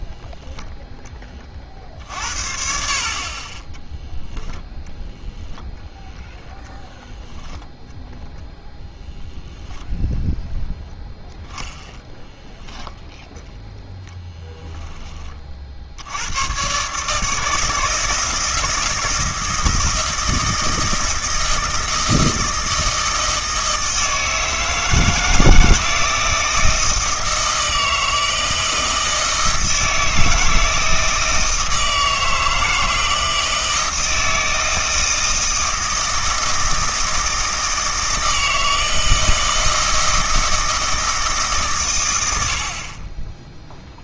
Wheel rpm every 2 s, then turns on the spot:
0, 50, 0, 0, 0, 0, 0, 10, 120, 160, 160, 160, 160, 160, 160, 160, 160, 160, 160, 160, 160, 60.
none